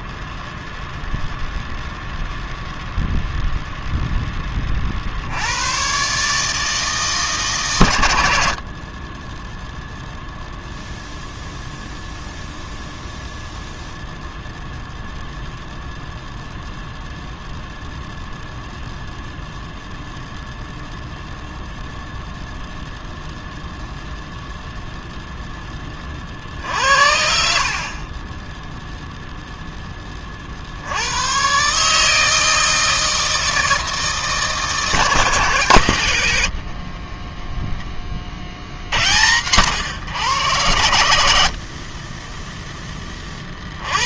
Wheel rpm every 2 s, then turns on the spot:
0, 0, 90, 140, 0, 0, 0, 0, 0, 0, 0, 0, 0, 60, 0, 100, 160, 150, 20, 90, 50, 40.
36-38